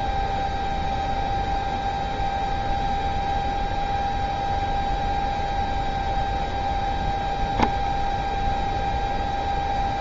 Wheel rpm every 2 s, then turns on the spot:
0, 0, 0, 0, 0.
none